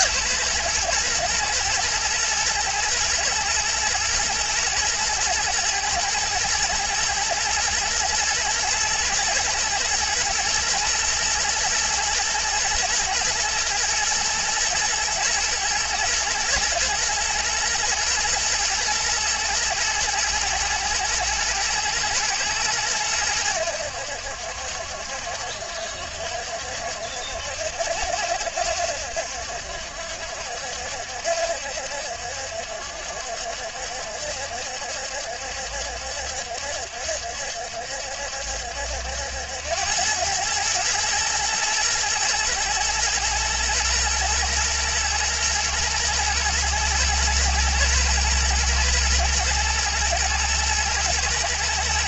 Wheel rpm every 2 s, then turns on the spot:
120, 110, 120, 120, 120, 120, 110, 110, 110, 120, 110, 110, 70, 70, 70, 70, 70, 70, 70, 70, 110, 110, 120, 120, 120, 110.
none